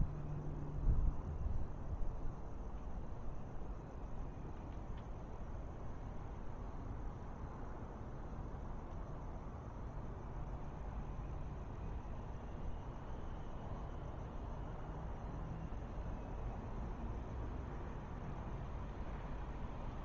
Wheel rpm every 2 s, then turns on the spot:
0, 0, 0, 0, 0, 0, 0, 0, 0, 0.
none